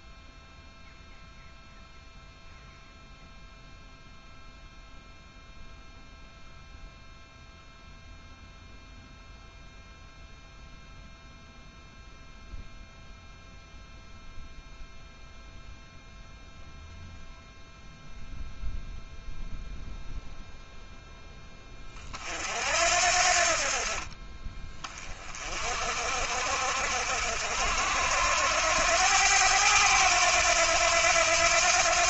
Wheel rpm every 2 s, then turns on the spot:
0, 0, 0, 0, 0, 0, 0, 0, 0, 0, 0, 60, 30, 60, 90, 90.
none